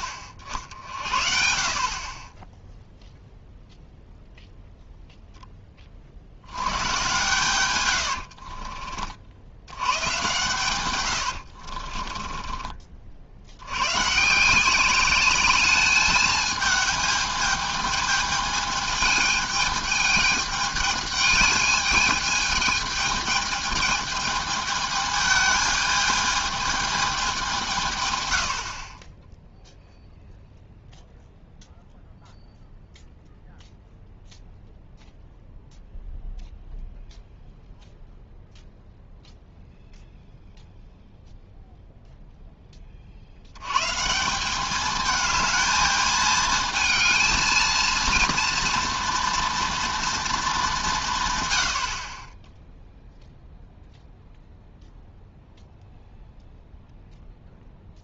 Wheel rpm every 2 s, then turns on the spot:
60, 10, 0, 100, 50, 120, 30, 180, 210, 210, 210, 210, 220, 210, 60, 0, 0, 0, 0, 0, 0, 10, 200, 220, 230, 200, 10, 0, 0.
8-10 12-14